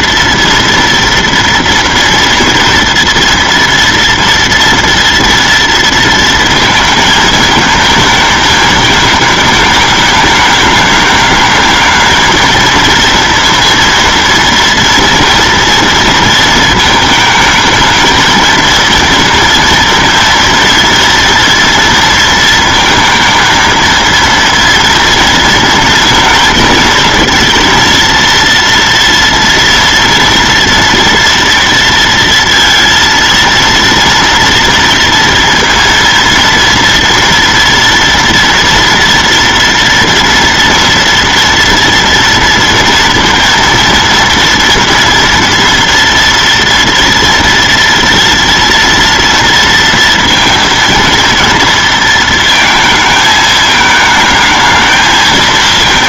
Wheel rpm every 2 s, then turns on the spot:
230, 230, 230, 230, 220, 210, 220, 230, 230, 230, 230, 230, 230, 220, 230, 230, 230, 230, 230, 230, 230, 230, 230, 230, 240, 230, 220, 220.
none